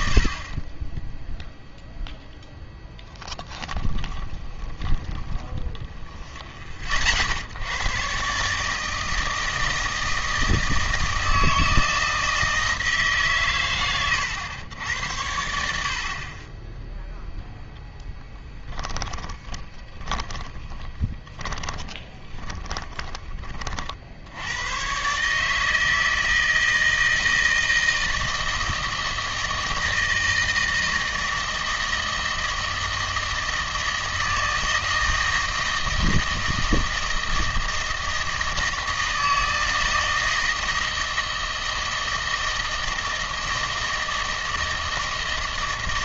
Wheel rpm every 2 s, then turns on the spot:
30, 0, 20, 50, 150, 160, 160, 90, 10, 10, 20, 10, 90, 160, 160, 160, 160, 160, 160, 160, 160, 160, 160.
4-6 18-24